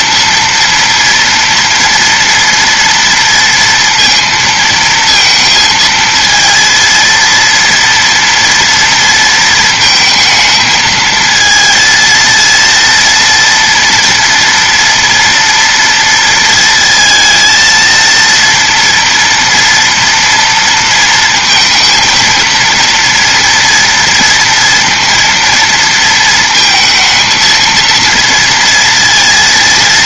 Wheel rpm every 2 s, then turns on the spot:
230, 230, 230, 230, 230, 220, 230, 240, 230, 240, 230, 230, 230, 220, 230.
none